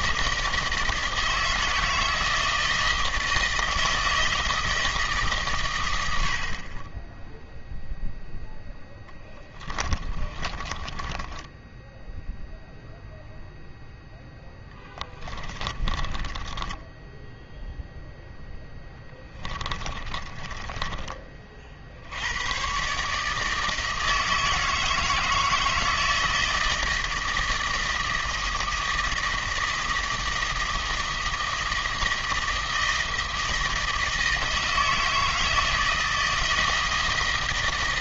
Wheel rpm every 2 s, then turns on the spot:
160, 160, 110, 0, 40, 10, 0, 30, 0, 20, 50, 160, 160, 160, 160, 160, 160, 160, 160.
8-12 14-16 18-20